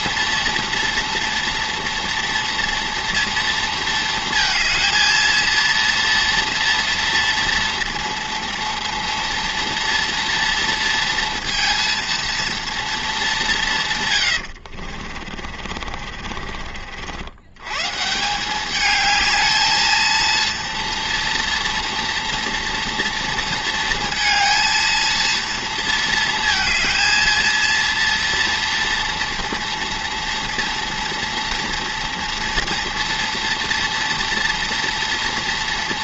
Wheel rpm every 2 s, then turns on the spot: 230, 230, 230, 230, 240, 230, 210, 50, 70, 210, 240, 230, 230, 230, 230, 230, 230, 240.
14-16